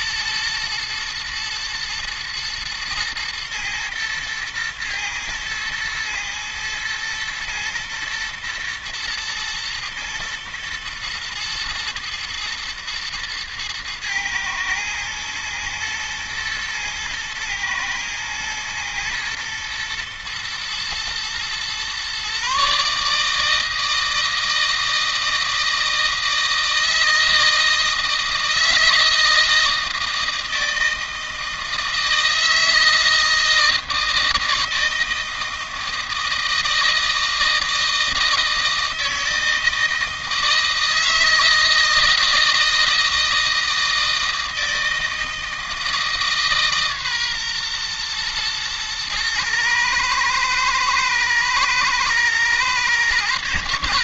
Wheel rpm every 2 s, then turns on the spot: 110, 110, 110, 110, 110, 110, 120, 120, 110, 120, 120, 150, 160, 160, 160, 160, 160, 160, 160, 160, 160, 160, 160, 140, 110, 110, 120.
none